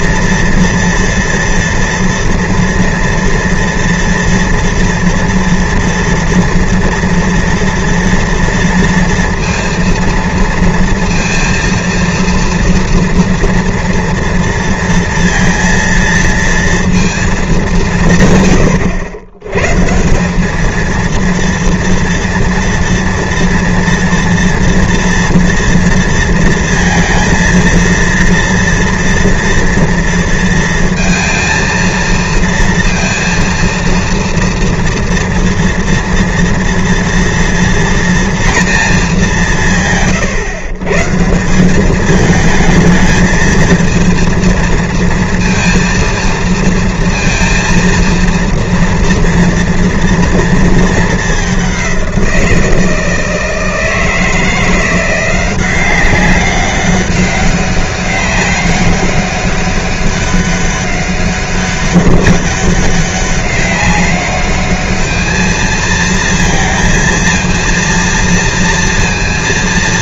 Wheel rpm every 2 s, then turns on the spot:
230, 240, 230, 230, 230, 230, 230, 230, 230, 110, 210, 230, 230, 230, 230, 230, 230, 230, 230, 230, 140, 220, 230, 230, 230, 230, 170, 170, 190, 200, 200, 200, 210, 230, 230.
none